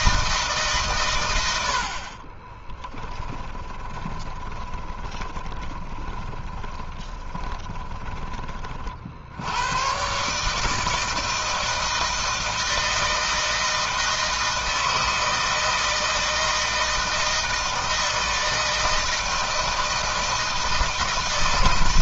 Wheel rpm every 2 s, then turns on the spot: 150, 20, 20, 20, 30, 140, 160, 160, 160, 160, 160.
2-8